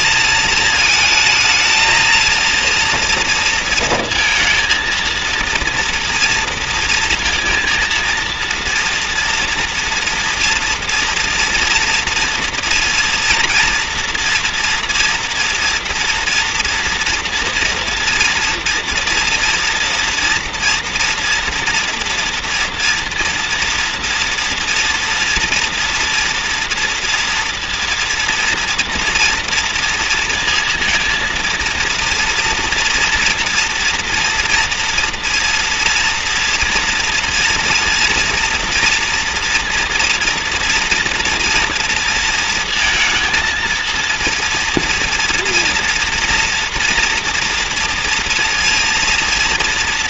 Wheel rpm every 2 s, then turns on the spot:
220, 230, 230, 230, 230, 230, 230, 230, 240, 230, 230, 240, 230, 240, 230, 230, 230, 230, 240, 230, 230, 230, 230, 230, 230.
none